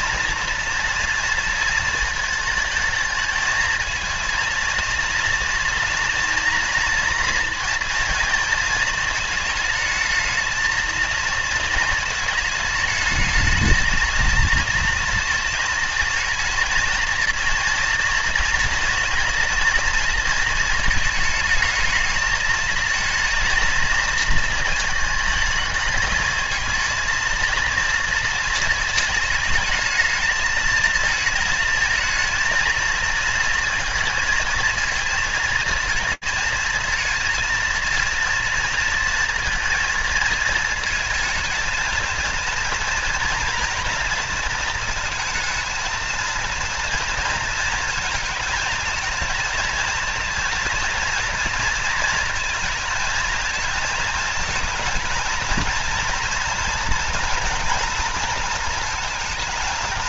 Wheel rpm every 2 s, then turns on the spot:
230, 220, 230, 230, 220, 220, 220, 230, 230, 230, 220, 220, 230, 220, 220, 220, 220, 230, 230, 230, 220, 230, 220, 230, 230, 230, 220, 220, 230, 230.
none